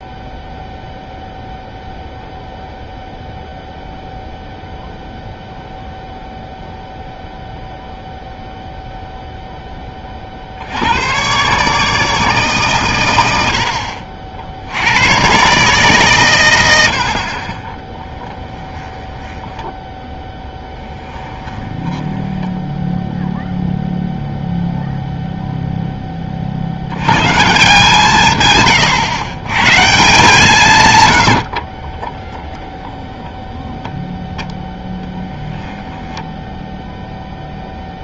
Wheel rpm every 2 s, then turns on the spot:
0, 0, 0, 0, 0, 80, 140, 80, 100, 10, 10, 10, 0, 80, 130, 150, 10, 10, 0.
18-24